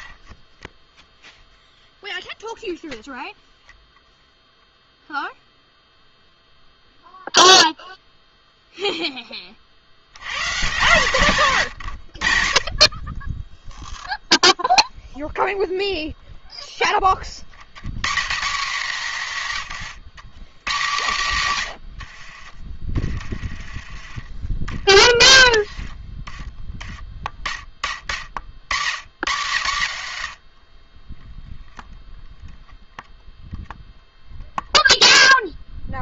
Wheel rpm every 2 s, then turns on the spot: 10, 0, 0, 0, 0, 150, 50, 0, 10, 170, 160, 40, 30, 20, 90, 40, 0, 0.
22-26